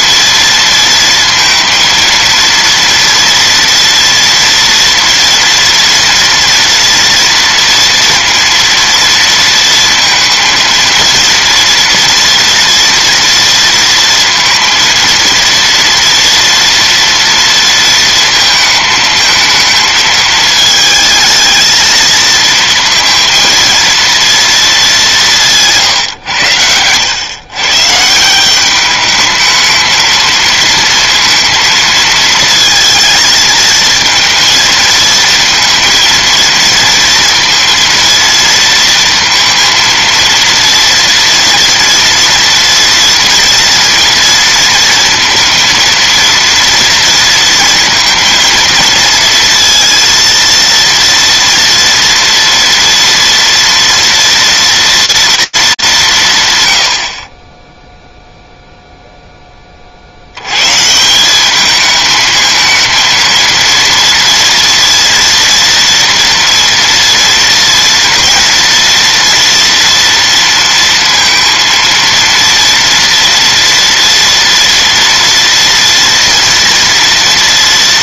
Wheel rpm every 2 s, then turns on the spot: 230, 230, 230, 230, 230, 230, 230, 230, 240, 220, 220, 230, 220, 100, 190, 230, 220, 230, 230, 230, 230, 230, 230, 230, 230, 230, 230, 230, 110, 0, 110, 220, 230, 230, 230, 230, 240, 230, 230.
none